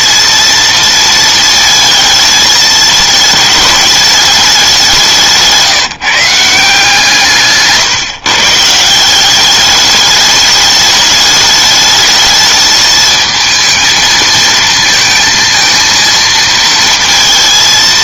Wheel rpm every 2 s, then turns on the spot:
230, 220, 190, 160, 150, 210, 210, 230, 230.
none